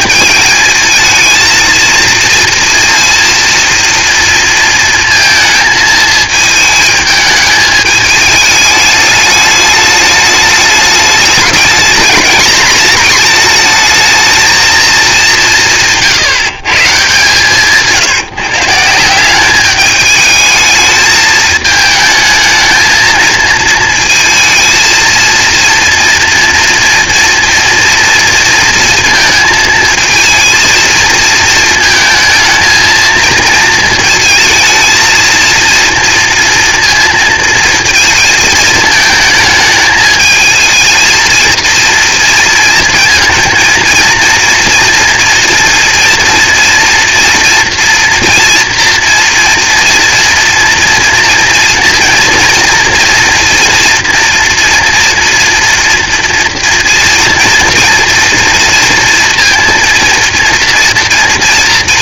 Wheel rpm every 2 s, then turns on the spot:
220, 230, 230, 220, 210, 210, 220, 220, 150, 160, 220, 220, 220, 230, 230, 220, 220, 220, 230, 220, 220, 230, 230, 230, 230, 230, 230, 230, 230, 230, 230.
none